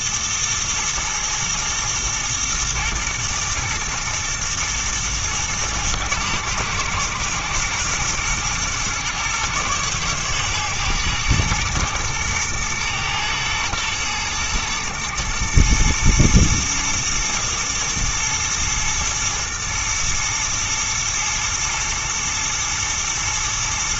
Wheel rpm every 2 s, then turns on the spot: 120, 110, 120, 110, 120, 120, 110, 110, 120, 110, 120, 110.
none